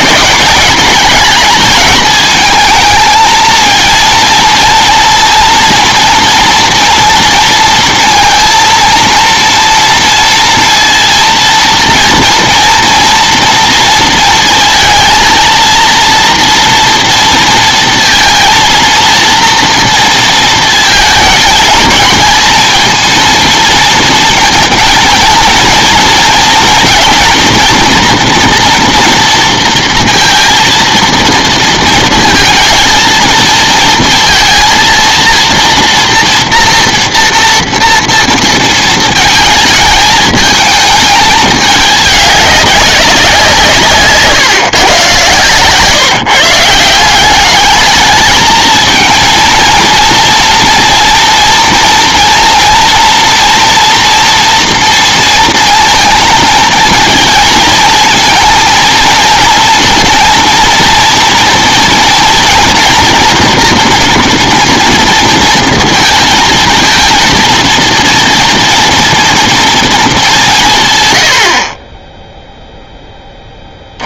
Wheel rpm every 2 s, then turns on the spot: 200, 220, 230, 230, 230, 230, 230, 230, 230, 230, 230, 220, 230, 230, 230, 230, 230, 230, 240, 230, 220, 200, 130, 160, 220, 230, 230, 240, 220, 220, 230, 230, 230, 220, 230, 180, 0.
none